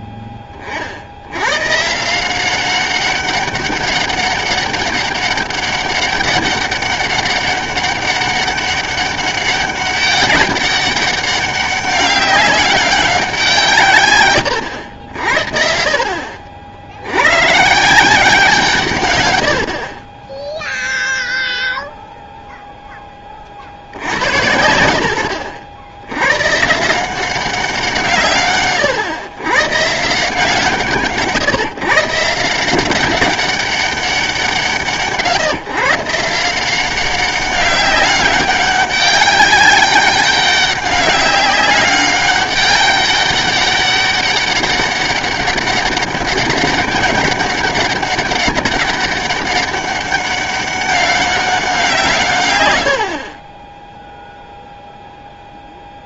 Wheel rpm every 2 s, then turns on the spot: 40, 190, 200, 200, 200, 190, 200, 90, 50, 160, 0, 0, 90, 140, 130, 150, 170, 150, 180, 200, 200, 200, 200, 200, 190, 200, 110, 0.
none